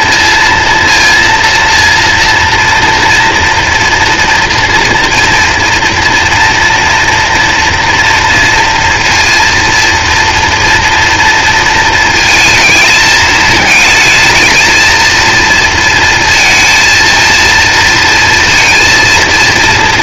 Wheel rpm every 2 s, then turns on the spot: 230, 230, 230, 230, 230, 230, 220, 220, 230, 230.
none